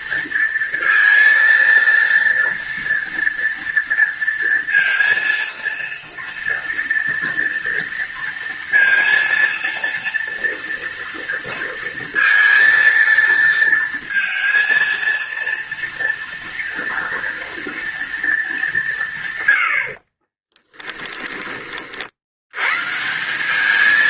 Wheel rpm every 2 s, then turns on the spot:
230, 230, 230, 230, 230, 230, 230, 230, 230, 200, 20, 100.
20-22